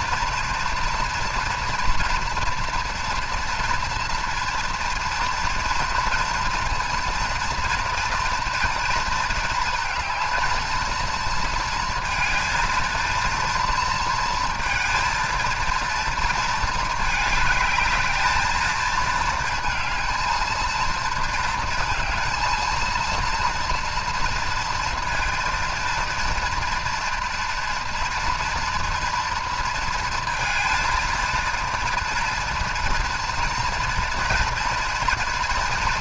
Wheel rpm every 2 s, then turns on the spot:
230, 240, 230, 230, 230, 230, 230, 230, 220, 220, 230, 230, 230, 240, 240, 230, 240, 230.
none